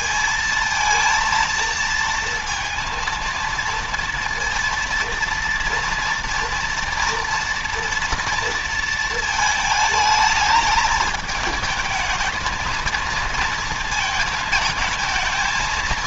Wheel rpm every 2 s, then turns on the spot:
230, 230, 230, 230, 230, 220, 230, 220.
none